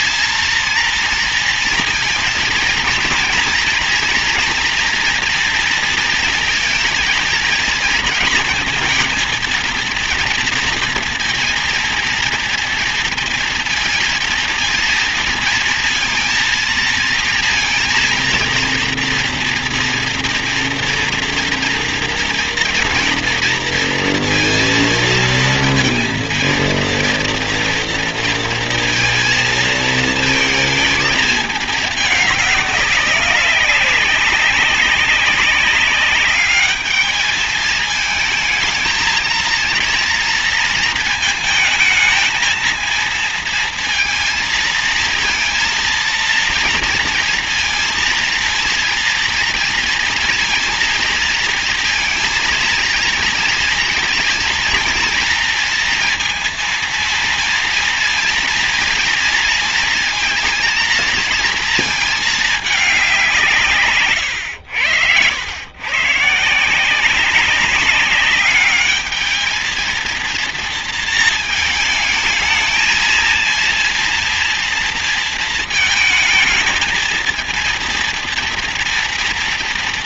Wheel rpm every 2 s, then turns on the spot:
230, 230, 230, 230, 230, 230, 230, 230, 230, 230, 230, 230, 230, 230, 230, 220, 200, 190, 200, 220, 230, 230, 230, 230, 230, 230, 230, 230, 230, 240, 230, 220, 110, 150, 200, 230, 230, 230, 220, 230.
64-66